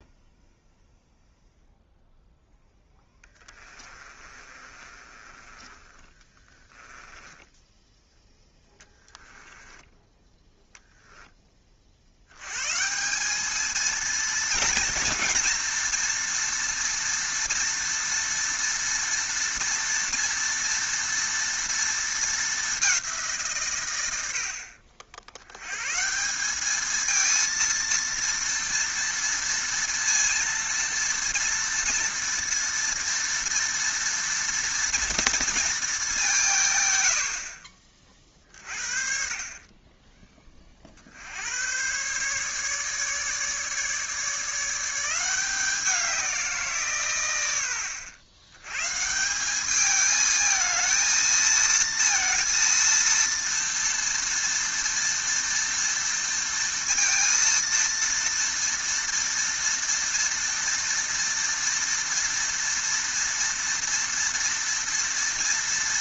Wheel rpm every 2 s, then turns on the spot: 0, 10, 30, 30, 10, 0, 160, 230, 230, 230, 230, 190, 60, 220, 230, 230, 230, 230, 110, 50, 50, 150, 170, 140, 160, 220, 230, 230, 230, 230, 230, 230, 230.
2-10